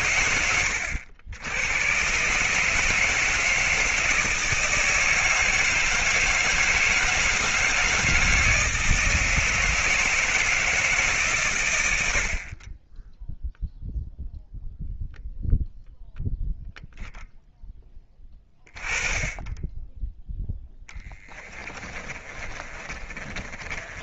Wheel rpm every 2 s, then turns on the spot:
100, 160, 160, 160, 160, 150, 10, 0, 0, 20, 20, 30.
20-24